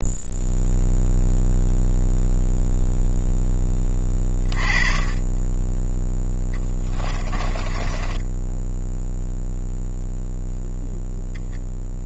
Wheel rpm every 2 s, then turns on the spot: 0, 0, 20, 20, 10, 0.
6-10